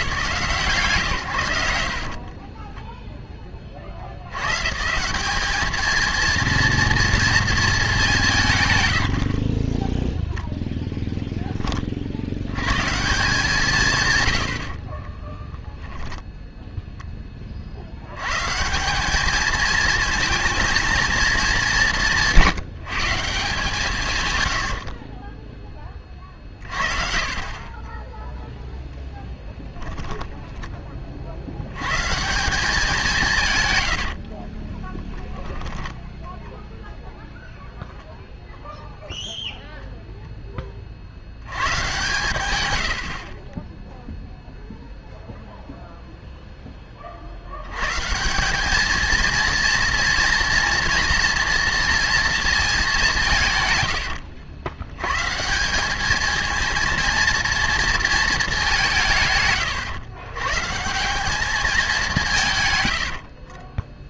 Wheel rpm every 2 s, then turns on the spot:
120, 10, 160, 230, 110, 0, 140, 30, 10, 180, 230, 170, 60, 40, 0, 20, 190, 20, 0, 0, 50, 90, 0, 30, 220, 230, 210, 100, 230, 170, 160, 100.
2-4 14-16 24-28 34-36 62-64